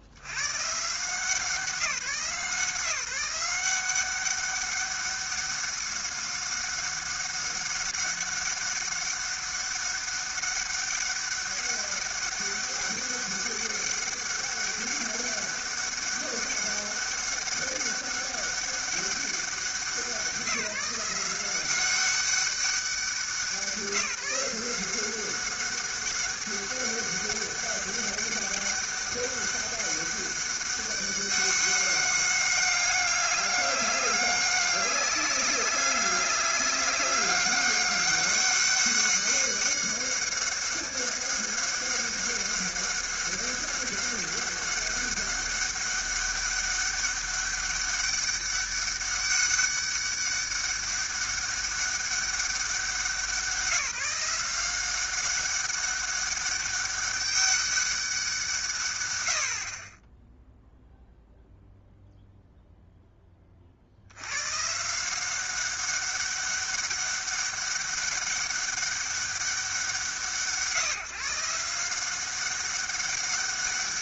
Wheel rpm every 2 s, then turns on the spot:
130, 160, 200, 190, 200, 200, 200, 200, 200, 200, 170, 190, 180, 200, 200, 200, 200, 200, 200, 200, 190, 190, 200, 200, 200, 200, 190, 180, 200, 150, 0, 0, 130, 200, 200, 150, 190.
none